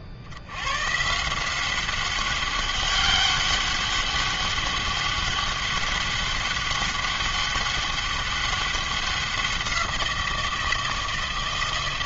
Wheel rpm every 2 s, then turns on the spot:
80, 200, 200, 200, 200, 170.
none